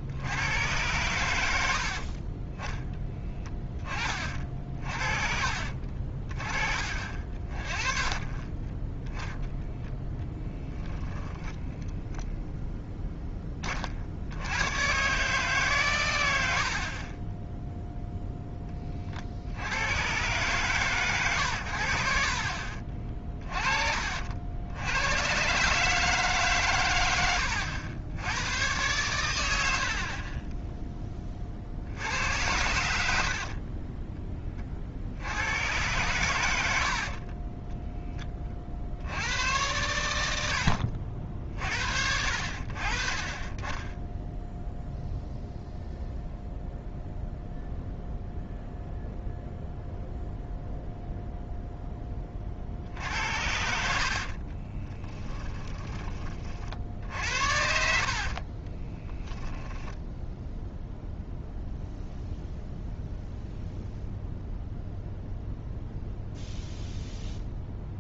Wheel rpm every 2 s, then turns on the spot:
100, 10, 40, 40, 10, 10, 0, 100, 70, 20, 140, 50, 80, 110, 110, 20, 80, 40, 70, 60, 60, 60, 0, 0, 0, 0, 50, 20, 60, 30, 0, 0, 0, 0.
10-12 54-56 58-60